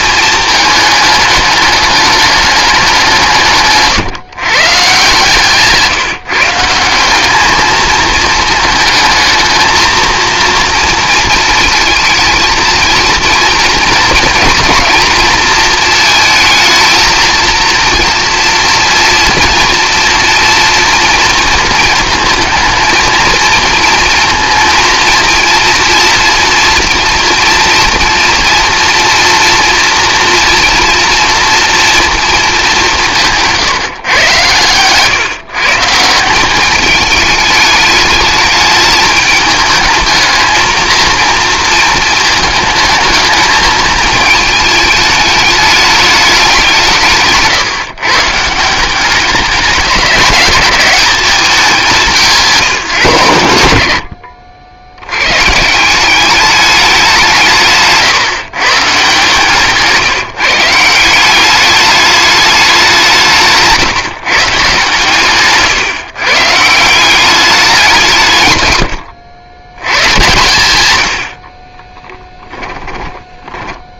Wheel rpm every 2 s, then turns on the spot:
220, 200, 140, 180, 220, 230, 230, 230, 230, 230, 240, 230, 230, 230, 240, 230, 200, 130, 210, 220, 220, 220, 210, 180, 190, 210, 150, 80, 200, 130, 170, 190, 150, 160, 90, 100, 20.
34-36 68-70 72-74